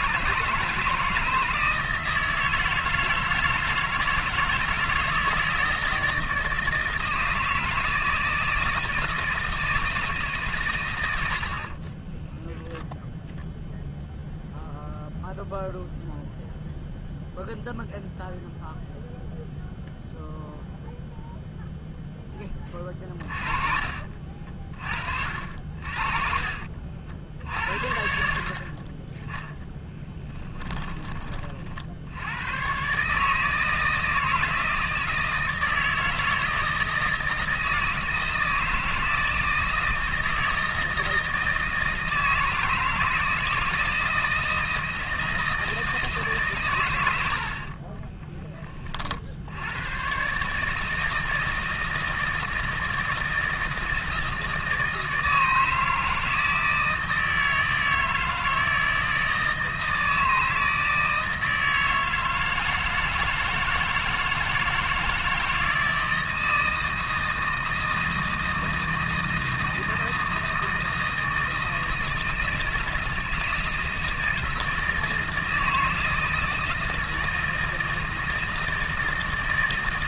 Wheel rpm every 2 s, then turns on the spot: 160, 160, 160, 160, 160, 140, 0, 0, 0, 0, 0, 30, 50, 50, 20, 20, 150, 160, 160, 160, 160, 160, 160, 110, 30, 150, 160, 160, 160, 160, 160, 160, 160, 160, 160, 160, 160, 160, 160, 160.
22-26